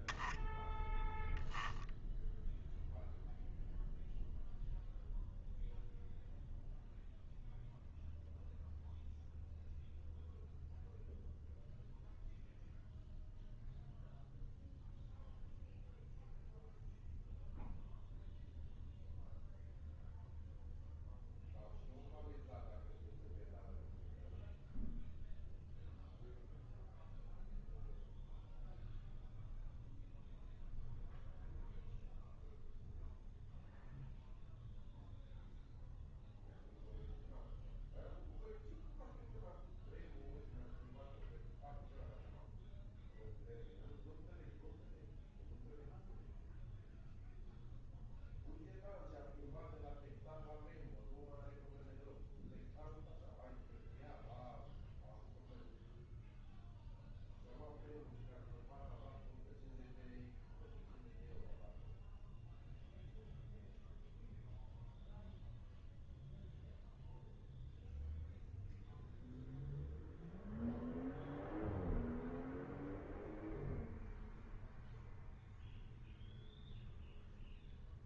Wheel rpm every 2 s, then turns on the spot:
0, 0, 0, 0, 0, 0, 0, 0, 0, 0, 0, 0, 0, 0, 0, 0, 0, 0, 0, 0, 0, 0, 0, 0, 0, 0, 0, 0, 0, 0, 0, 0, 0, 0, 0, 0, 0, 0, 0.
none